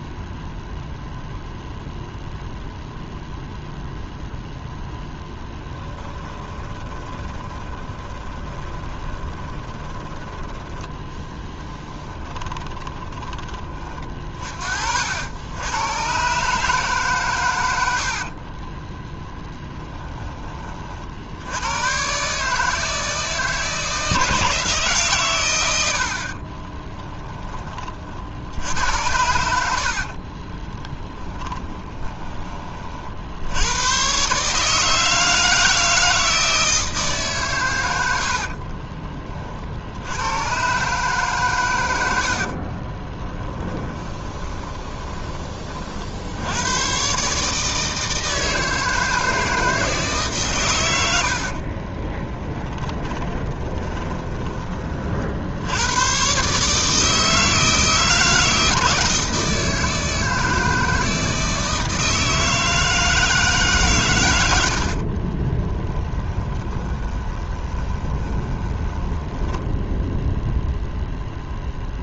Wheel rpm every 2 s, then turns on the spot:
0, 0, 0, 20, 20, 10, 20, 60, 140, 20, 50, 160, 150, 30, 80, 20, 40, 160, 160, 40, 140, 30, 20, 120, 160, 100, 20, 40, 150, 160, 160, 160, 60, 20, 10, 0.
6-10 12-14 18-20 26-28 30-32 38-40 42-44 52-54 64-70